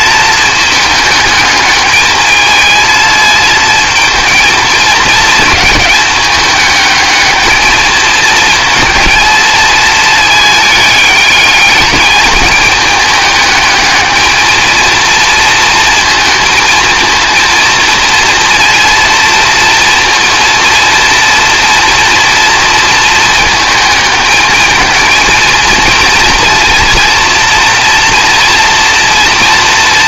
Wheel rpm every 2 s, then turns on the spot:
220, 220, 220, 210, 230, 220, 210, 220, 230, 230, 230, 230, 220, 240, 240.
none